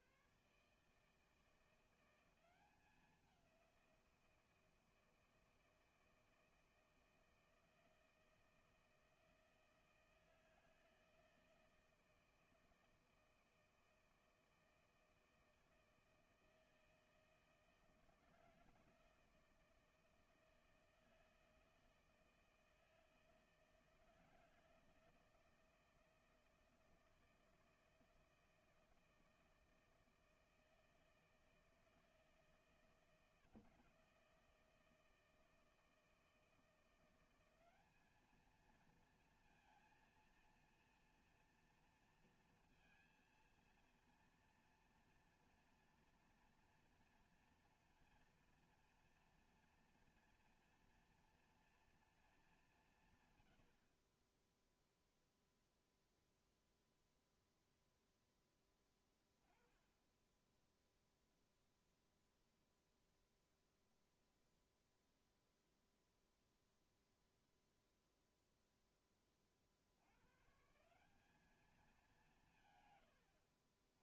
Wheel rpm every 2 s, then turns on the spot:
140, 190, 170, 170, 160, 160, 160, 160, 160, 160, 160, 160, 160, 160, 160, 160, 160, 160, 160, 220, 230, 220, 230, 240, 230, 230, 210, 20, 0, 10, 10, 0, 0, 0, 0, 120, 190.
none